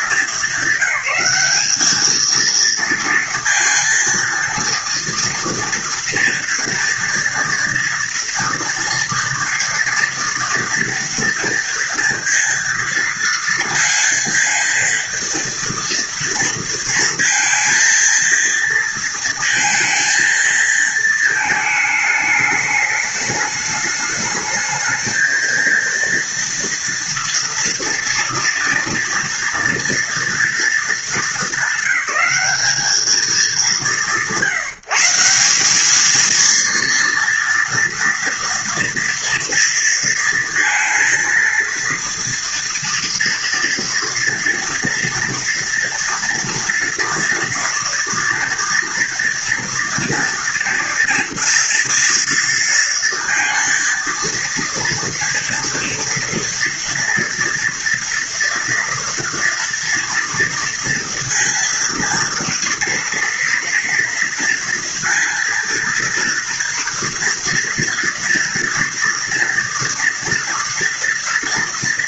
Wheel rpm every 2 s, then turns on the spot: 210, 220, 230, 230, 230, 230, 230, 230, 230, 230, 230, 210, 210, 230, 230, 230, 200, 170, 230, 230, 230, 230, 230, 230, 240, 230, 230, 230, 230, 230, 230, 230, 240, 230, 240, 230.
none